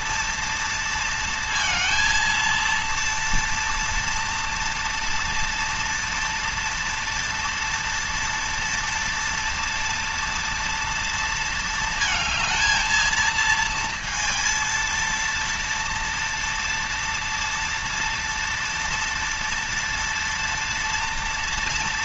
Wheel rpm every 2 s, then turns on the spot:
230, 230, 230, 230, 230, 230, 220, 230, 230, 230, 230.
none